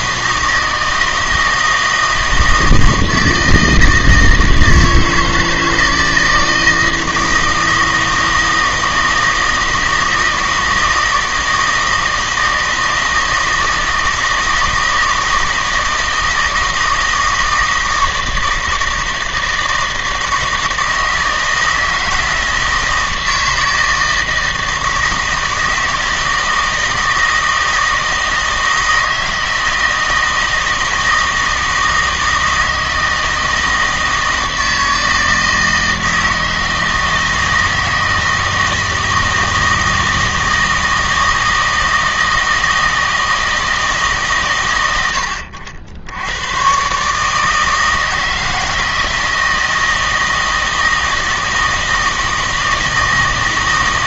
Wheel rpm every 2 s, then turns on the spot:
160, 160, 160, 160, 160, 160, 160, 160, 160, 160, 160, 160, 160, 160, 160, 160, 160, 160, 160, 160, 160, 160, 100, 130, 160, 160, 160.
none